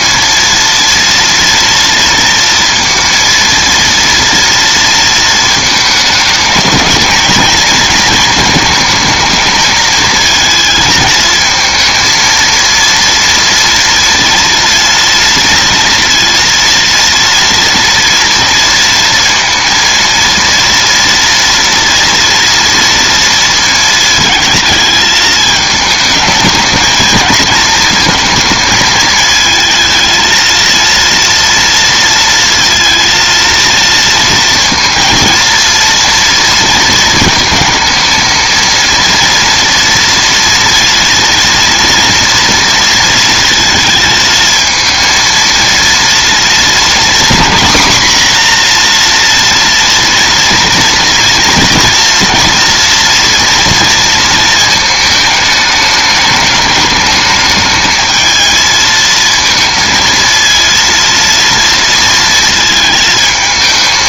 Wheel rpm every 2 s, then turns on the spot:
230, 230, 230, 220, 220, 220, 230, 230, 230, 230, 230, 230, 220, 220, 220, 230, 230, 230, 230, 230, 230, 230, 220, 240, 240, 230, 230, 220, 210, 220, 230, 220.
none